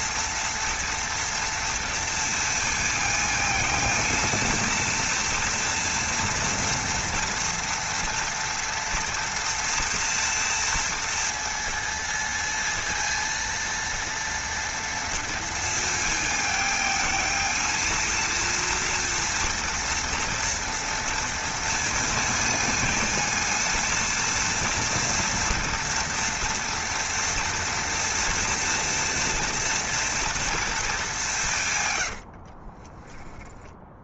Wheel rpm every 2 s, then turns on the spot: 230, 230, 230, 230, 240, 230, 230, 230, 220, 230, 230, 230, 230, 230, 230, 200, 20.
none